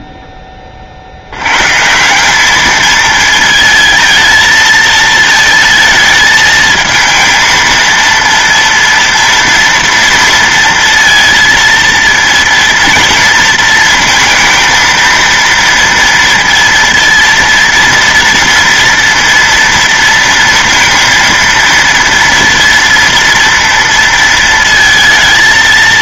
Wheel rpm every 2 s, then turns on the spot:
30, 210, 220, 220, 230, 230, 230, 230, 230, 230, 230, 230, 230.
none